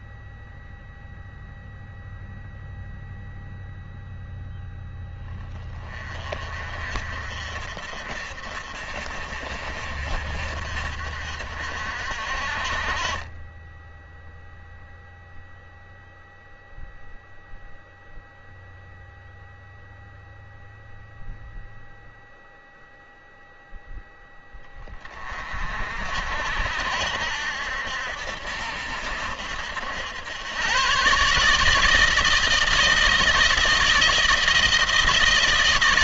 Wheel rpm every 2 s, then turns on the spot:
0, 0, 0, 40, 40, 50, 40, 0, 0, 0, 0, 0, 10, 60, 70, 110, 160, 160.
none